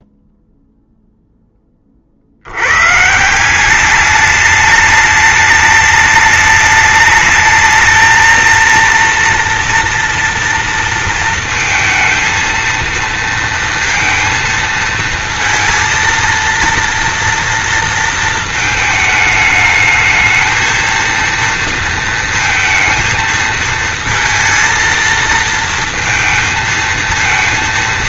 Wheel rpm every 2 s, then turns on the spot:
0, 150, 210, 210, 230, 230, 230, 230, 230, 220, 230, 230, 230, 220.
none